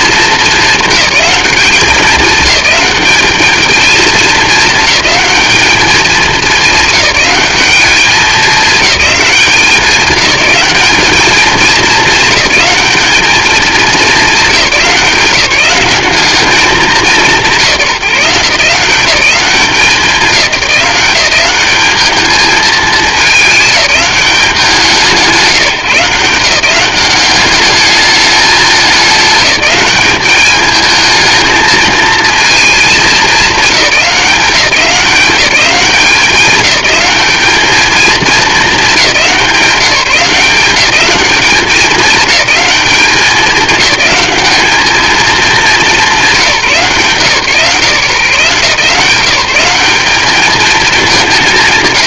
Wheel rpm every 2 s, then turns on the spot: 210, 210, 220, 200, 210, 210, 200, 200, 200, 180, 190, 220, 180, 180, 210, 220, 220, 180, 200, 210, 200, 210, 210, 140, 160, 210.
none